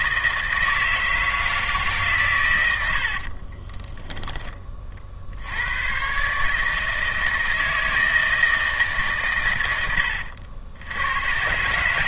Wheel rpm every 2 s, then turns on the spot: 160, 110, 20, 150, 160, 80.
none